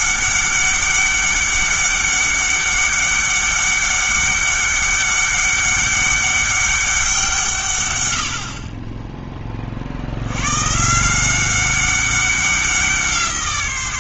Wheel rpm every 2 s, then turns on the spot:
200, 200, 200, 200, 40, 140, 180.
none